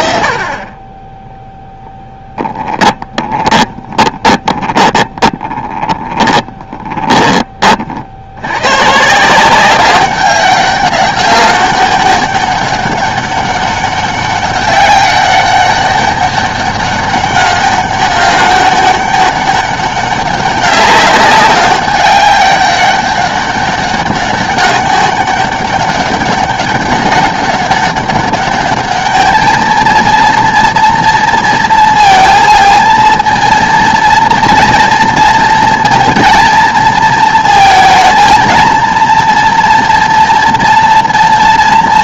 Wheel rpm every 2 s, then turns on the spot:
30, 30, 20, 30, 130, 200, 200, 200, 200, 200, 190, 200, 200, 200, 210, 230, 220, 230, 230, 230, 230.
2-8